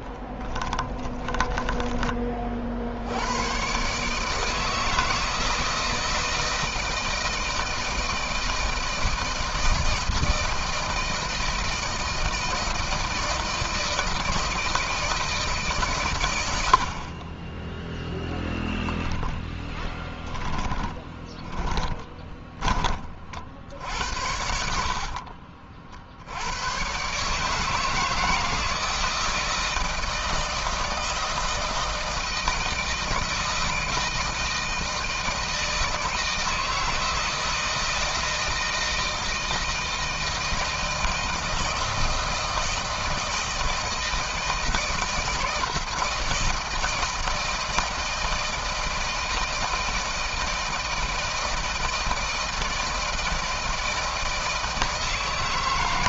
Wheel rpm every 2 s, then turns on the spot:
20, 60, 160, 160, 160, 160, 160, 160, 50, 10, 20, 30, 50, 120, 160, 160, 160, 160, 160, 160, 160, 160, 160, 160, 160, 160, 160, 160.
0-2 20-22 24-26